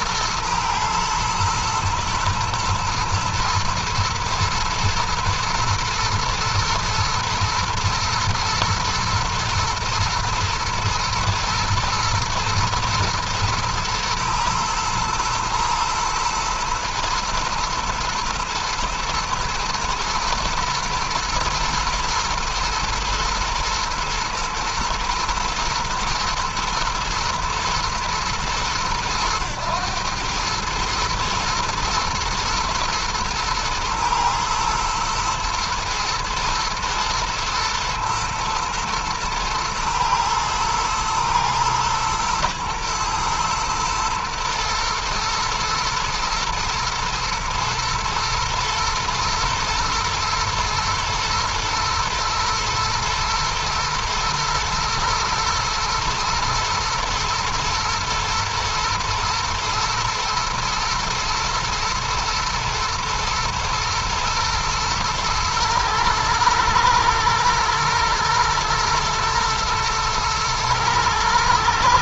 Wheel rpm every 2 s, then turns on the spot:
110, 110, 120, 110, 120, 110, 120, 120, 120, 120, 120, 120, 110, 120, 110, 110, 120, 110, 110, 110, 110, 110, 110, 110, 110, 120, 120, 120, 120, 120, 120, 120, 110, 110, 120, 110.
none